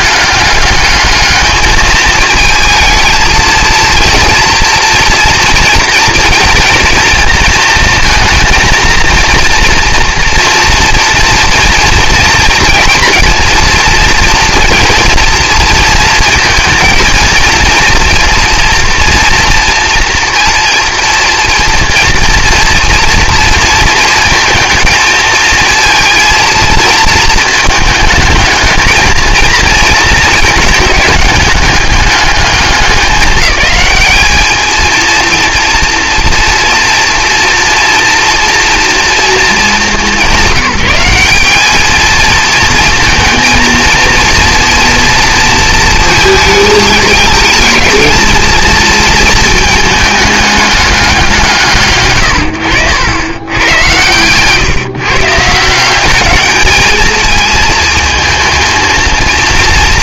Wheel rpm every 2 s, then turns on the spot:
210, 220, 230, 230, 230, 230, 230, 230, 230, 240, 230, 230, 230, 230, 220, 220, 190, 220, 240, 230, 200, 220, 230, 220, 230, 210, 90, 130, 210, 230.
none